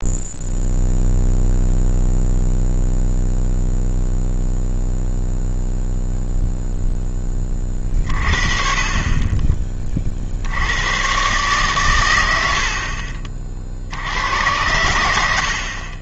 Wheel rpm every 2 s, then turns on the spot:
0, 0, 0, 0, 40, 90, 60, 100.
none